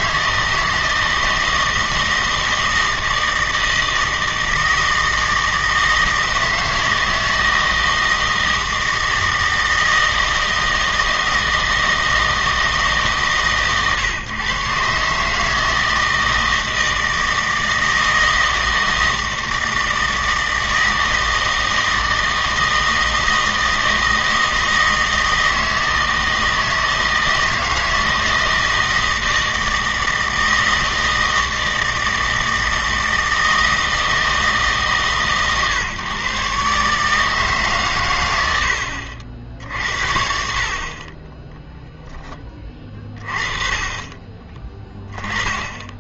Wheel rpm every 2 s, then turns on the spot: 160, 160, 160, 160, 160, 160, 150, 130, 160, 160, 160, 160, 160, 160, 160, 160, 160, 150, 140, 90, 50, 20, 20.
none